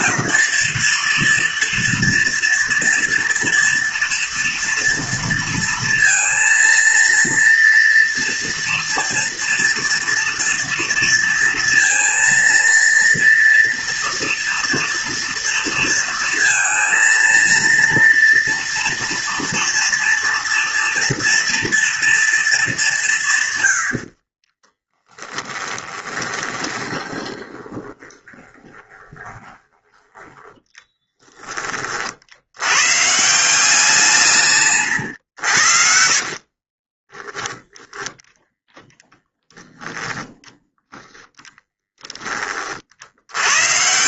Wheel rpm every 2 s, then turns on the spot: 230, 230, 230, 230, 230, 230, 230, 230, 230, 230, 230, 180, 10, 20, 20, 10, 140, 130, 30, 20, 20, 70.
24-30 34-38